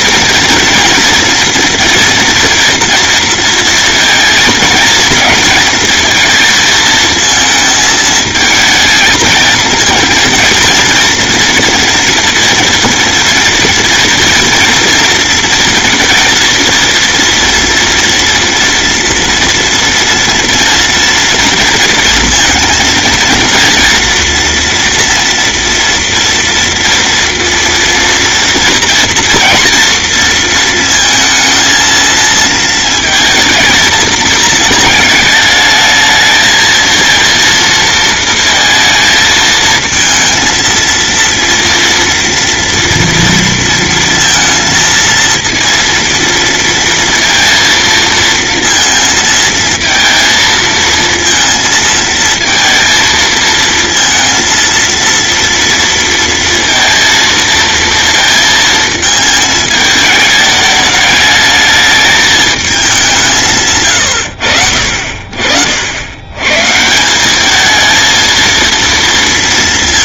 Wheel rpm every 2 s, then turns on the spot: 230, 240, 230, 230, 220, 230, 230, 230, 230, 230, 230, 230, 240, 230, 230, 230, 230, 230, 220, 230, 230, 230, 230, 230, 230, 230, 220, 230, 230, 230, 210, 210, 60, 130, 230.
none